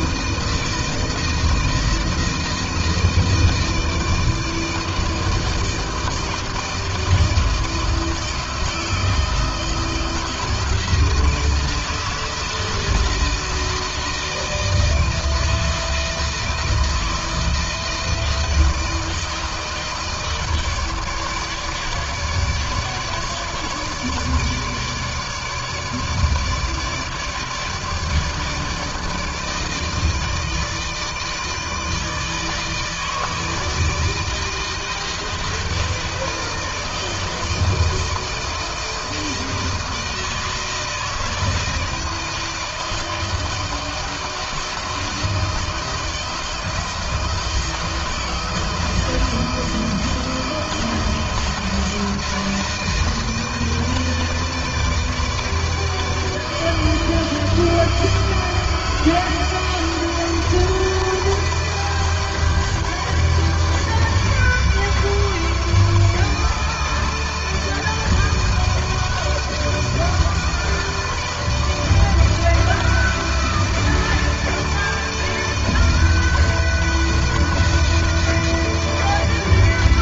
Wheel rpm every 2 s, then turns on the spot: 160, 160, 160, 160, 160, 160, 160, 160, 160, 160, 160, 150, 160, 150, 160, 160, 160, 160, 160, 160, 160, 160, 160, 160, 160, 160, 160, 160, 160, 160, 160, 160, 150, 160, 160, 160, 160, 160, 160, 160.
none